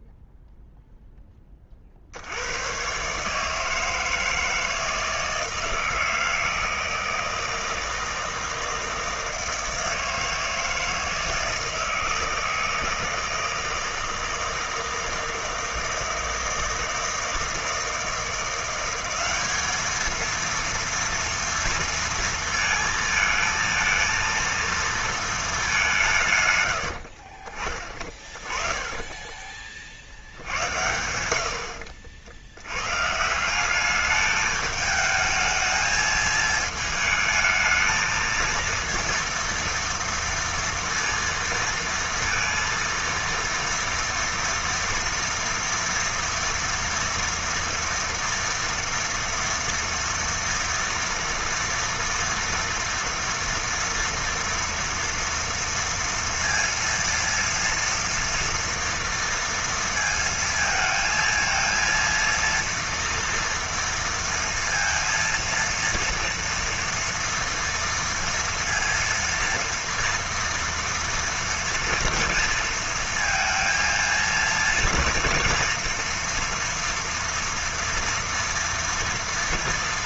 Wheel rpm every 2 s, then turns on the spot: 0, 130, 160, 160, 160, 160, 160, 160, 160, 190, 230, 230, 230, 80, 20, 80, 130, 210, 220, 230, 230, 230, 230, 230, 230, 230, 240, 230, 230, 230, 230, 230, 230, 240, 230, 230, 230, 230, 230, 230.
26-30